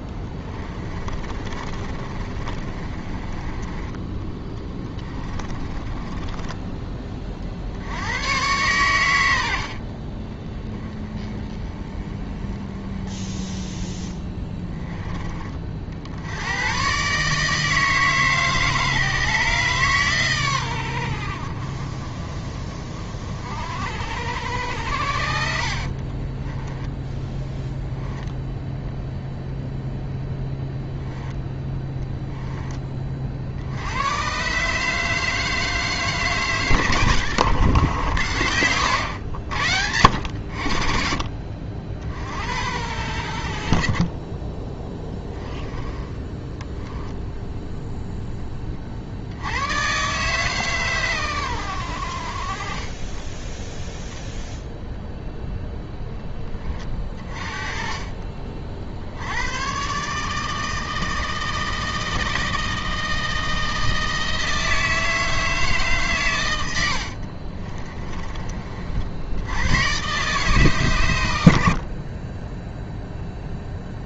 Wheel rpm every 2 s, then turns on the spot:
20, 30, 20, 20, 100, 20, 20, 20, 120, 150, 90, 40, 80, 10, 0, 0, 20, 150, 130, 90, 50, 80, 10, 10, 20, 130, 20, 0, 20, 50, 160, 160, 160, 90, 40, 130, 0.
0-6 26-28 44-48 66-68